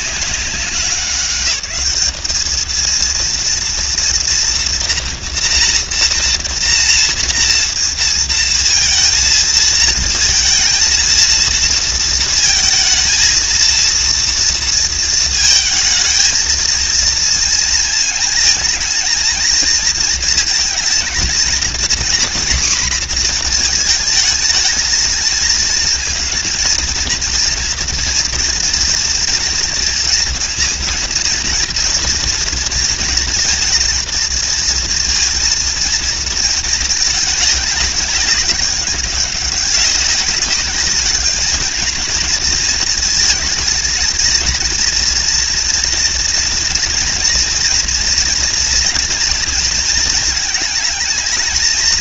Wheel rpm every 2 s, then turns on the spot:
190, 230, 230, 240, 230, 230, 230, 230, 230, 230, 230, 240, 220, 230, 230, 240, 230, 230, 210, 190, 210, 220, 230, 230, 230, 220.
none